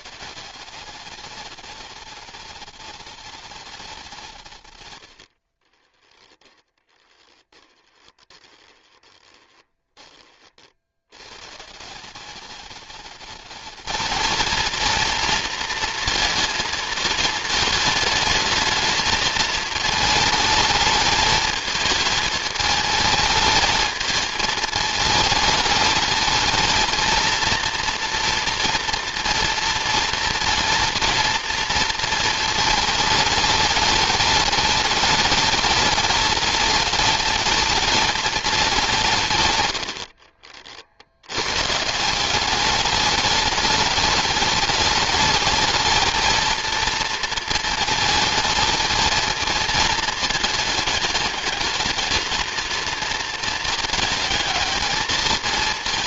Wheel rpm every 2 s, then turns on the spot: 190, 210, 140, 20, 20, 70, 210, 230, 230, 220, 220, 220, 220, 230, 240, 230, 220, 210, 220, 190, 60, 210, 210, 230, 220, 220, 230, 220.
6-10